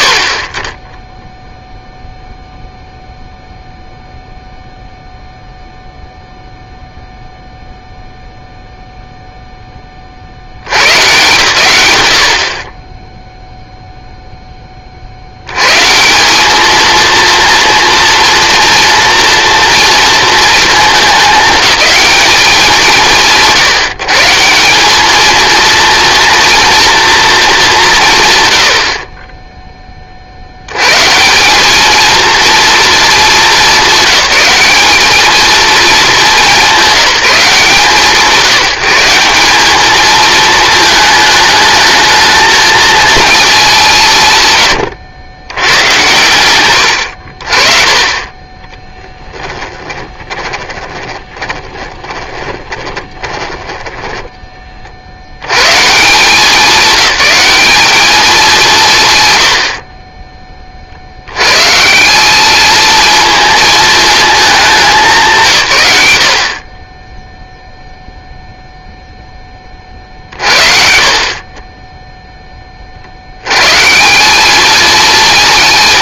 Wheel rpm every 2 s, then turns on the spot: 40, 0, 0, 0, 0, 100, 30, 10, 220, 230, 220, 150, 190, 230, 70, 100, 220, 200, 200, 170, 220, 230, 120, 110, 20, 10, 20, 40, 190, 170, 30, 220, 200, 40, 0, 50, 30, 210.
48-54